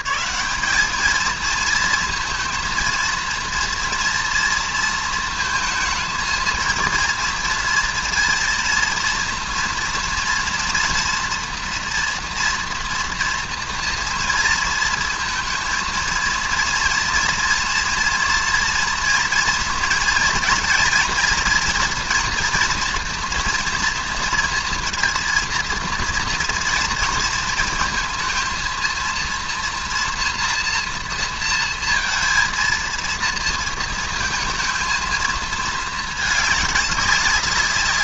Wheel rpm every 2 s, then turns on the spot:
210, 230, 230, 230, 230, 240, 240, 230, 230, 230, 230, 230, 230, 230, 230, 230, 230, 220, 200.
none